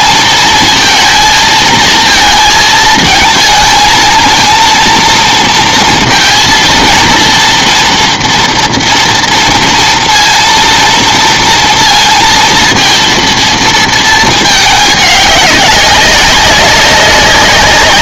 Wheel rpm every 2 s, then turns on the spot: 230, 220, 230, 230, 230, 230, 230, 210, 200.
none